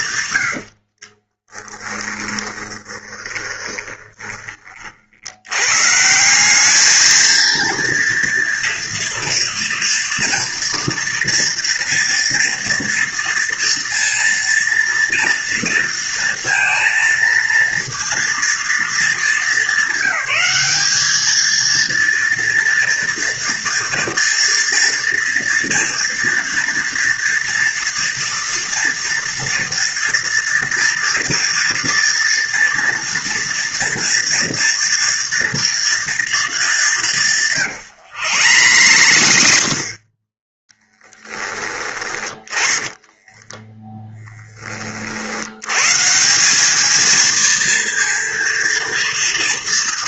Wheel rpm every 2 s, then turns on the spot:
50, 20, 50, 220, 230, 230, 230, 230, 230, 230, 210, 230, 240, 230, 230, 240, 240, 230, 200, 100, 10, 20, 30, 210, 230.
0-4 38-40 42-44